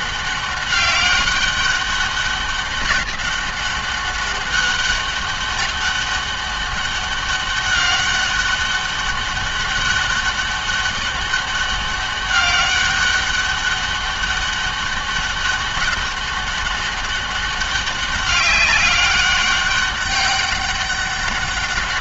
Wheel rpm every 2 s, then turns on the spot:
200, 200, 200, 200, 200, 200, 200, 200, 200, 190, 200.
none